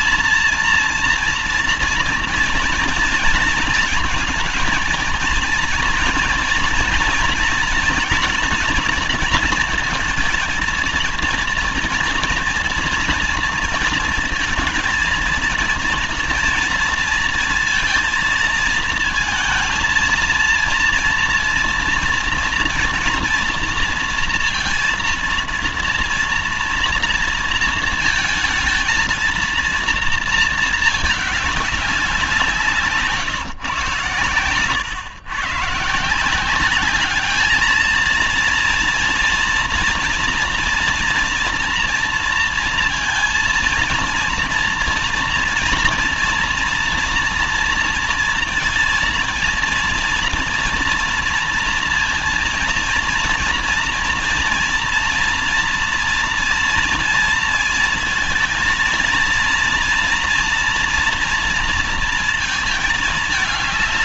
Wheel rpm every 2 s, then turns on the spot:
230, 230, 230, 230, 240, 230, 240, 230, 230, 230, 230, 230, 230, 230, 230, 220, 180, 110, 190, 230, 240, 230, 230, 230, 230, 230, 230, 230, 230, 230, 230, 220.
none